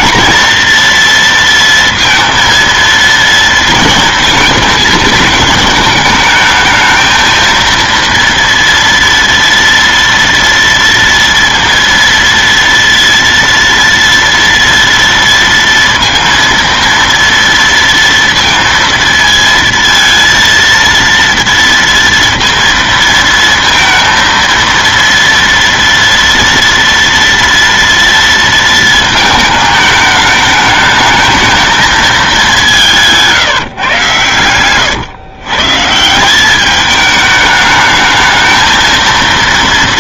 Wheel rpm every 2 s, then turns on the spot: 230, 230, 220, 220, 230, 230, 230, 230, 230, 230, 230, 230, 230, 230, 230, 210, 190, 120, 200, 220.
34-36